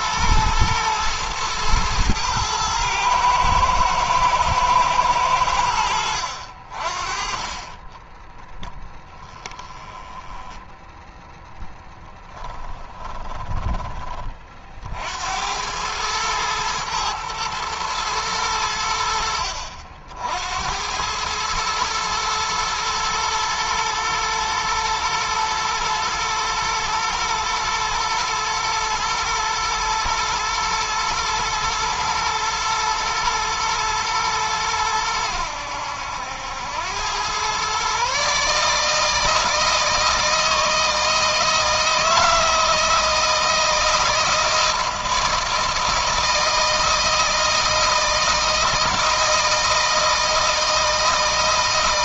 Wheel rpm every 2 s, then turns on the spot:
110, 110, 110, 70, 10, 10, 10, 30, 110, 110, 70, 110, 120, 120, 110, 110, 110, 110, 90, 140, 160, 160, 160, 160, 160, 160.
8-12